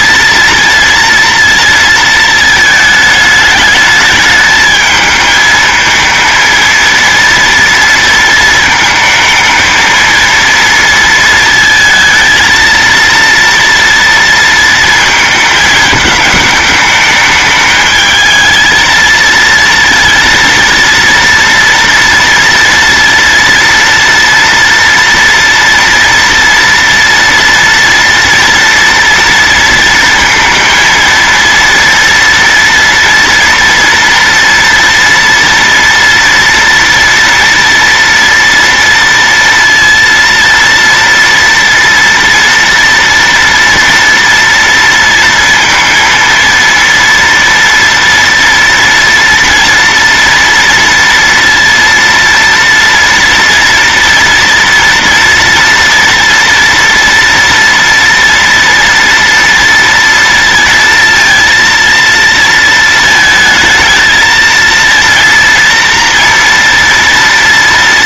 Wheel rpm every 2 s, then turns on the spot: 230, 220, 220, 230, 220, 230, 230, 230, 210, 220, 230, 230, 230, 240, 230, 230, 240, 230, 240, 230, 230, 230, 230, 230, 230, 230, 230, 230, 230, 230, 230, 230, 230, 230.
none